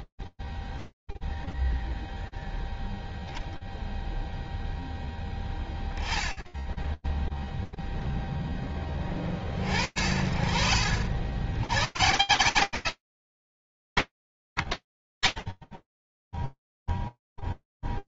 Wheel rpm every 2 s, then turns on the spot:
0, 0, 0, 0, 10, 60, 170, 180, 10.
none